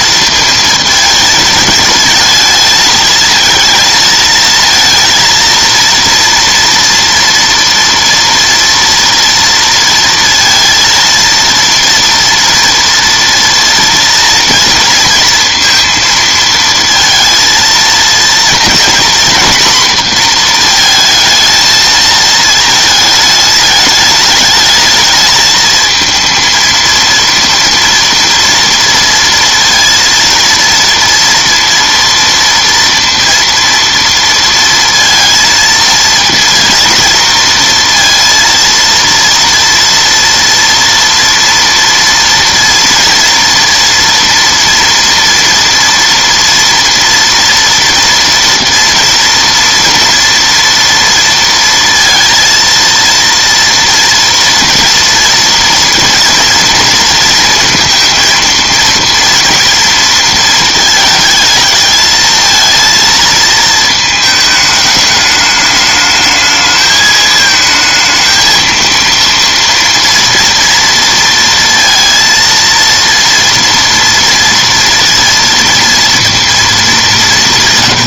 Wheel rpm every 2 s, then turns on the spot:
230, 220, 230, 230, 230, 230, 230, 230, 230, 230, 230, 220, 210, 230, 230, 230, 230, 230, 230, 230, 230, 230, 230, 230, 240, 230, 230, 230, 230, 230, 220, 220, 210, 220, 220, 230, 230, 230, 220.
none